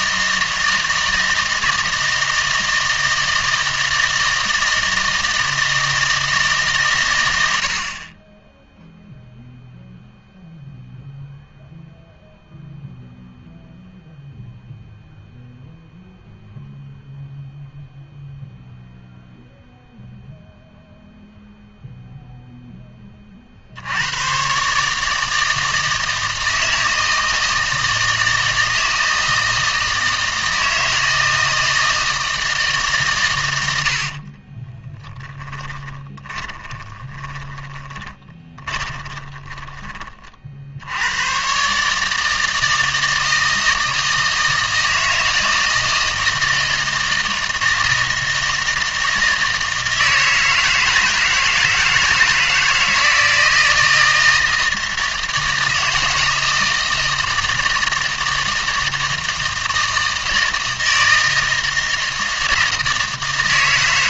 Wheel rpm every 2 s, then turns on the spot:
160, 160, 160, 140, 0, 0, 0, 0, 0, 0, 0, 10, 140, 160, 160, 160, 150, 20, 20, 20, 70, 160, 160, 160, 160, 160, 160, 160, 160, 160, 160, 160.
34-40